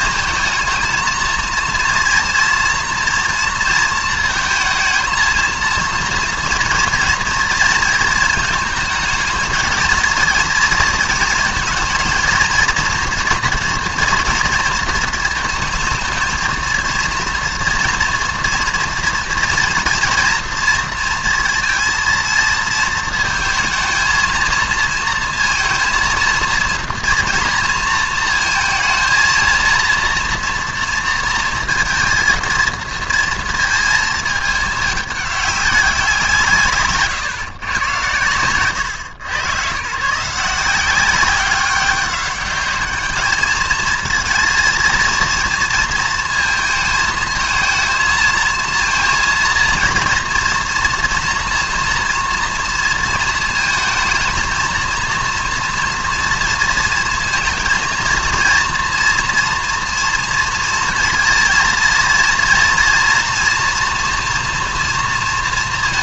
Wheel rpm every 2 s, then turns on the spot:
220, 230, 220, 230, 220, 230, 230, 230, 230, 230, 230, 230, 230, 230, 230, 230, 230, 220, 170, 110, 170, 200, 230, 230, 230, 240, 230, 220, 230, 230, 230, 240, 230.
none